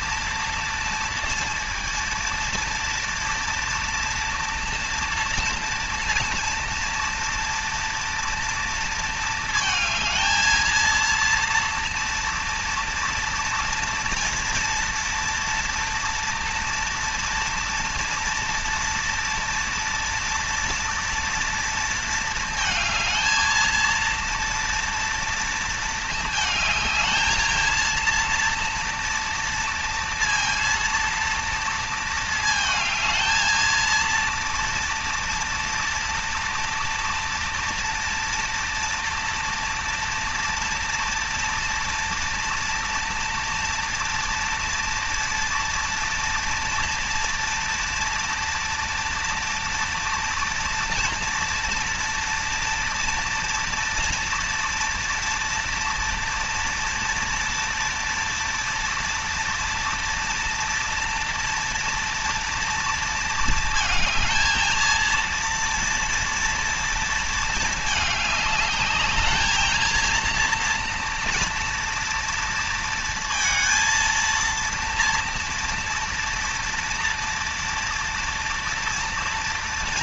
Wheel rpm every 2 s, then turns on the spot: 230, 230, 240, 230, 230, 230, 230, 230, 230, 230, 230, 220, 230, 220, 230, 230, 220, 230, 230, 230, 230, 240, 230, 230, 240, 230, 230, 230, 230, 230, 230, 230, 230, 230, 210, 240, 230, 230, 230, 240.
none